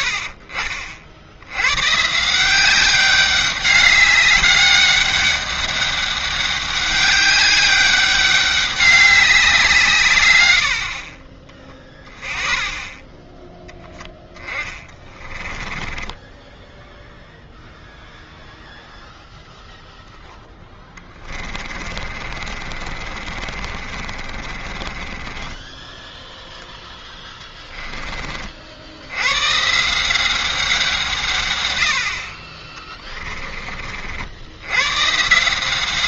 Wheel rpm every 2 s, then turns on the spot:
40, 190, 200, 200, 200, 70, 10, 20, 0, 0, 10, 40, 30, 0, 60, 190, 30, 110.
14-16 20-26